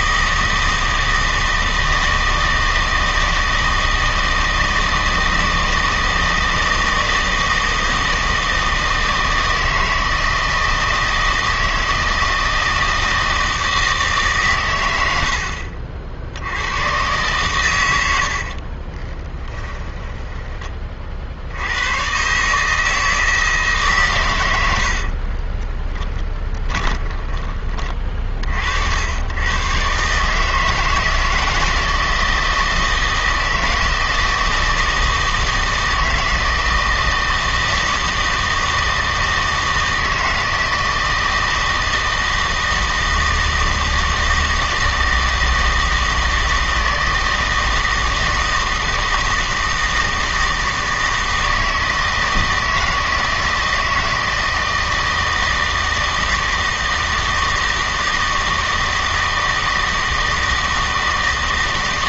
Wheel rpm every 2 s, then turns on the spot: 160, 160, 160, 160, 160, 160, 160, 120, 100, 40, 30, 150, 90, 20, 60, 160, 160, 160, 160, 160, 160, 160, 160, 160, 160, 160, 160, 160, 160, 160, 160.
18-20 24-28